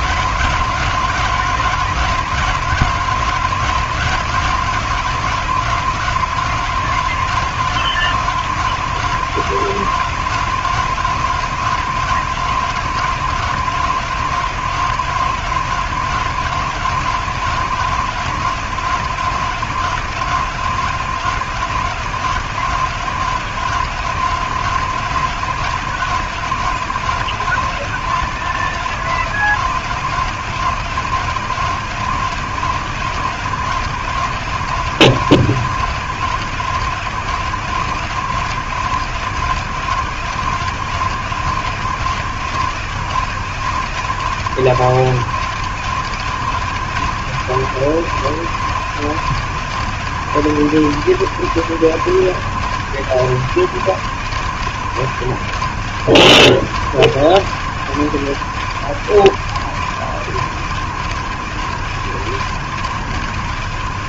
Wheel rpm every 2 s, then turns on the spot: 170, 160, 160, 160, 160, 150, 150, 150, 150, 150, 150, 140, 140, 150, 140, 140, 140, 140, 140, 130, 140, 130, 120, 130, 130, 130, 120, 130, 120, 120, 110, 120.
none